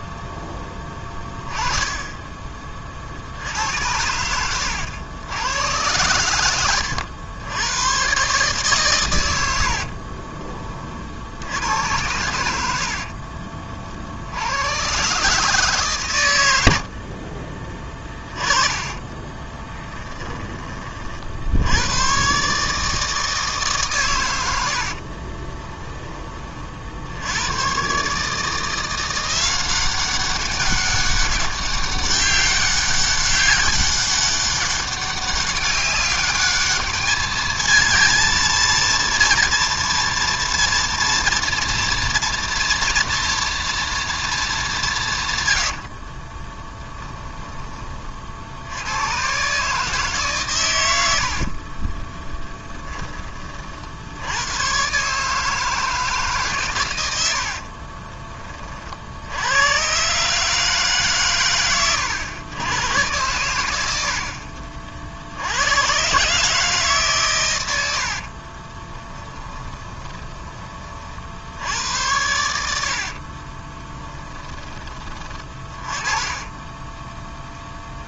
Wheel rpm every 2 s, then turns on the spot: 10, 40, 90, 80, 120, 40, 60, 130, 60, 30, 40, 150, 60, 60, 170, 200, 200, 200, 210, 230, 230, 240, 150, 10, 100, 100, 10, 130, 110, 50, 140, 110, 50, 140, 20, 30, 70, 20, 10.
12-14 18-20 24-26 46-48 68-70